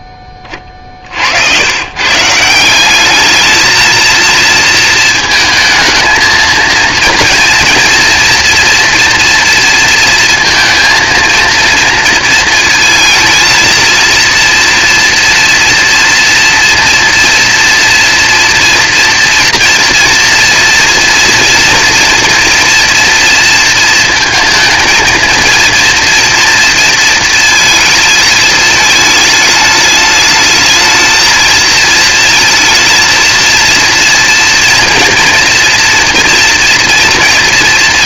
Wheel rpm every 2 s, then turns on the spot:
30, 180, 230, 230, 240, 230, 220, 230, 230, 230, 240, 230, 220, 230, 220, 220, 230, 230, 230.
none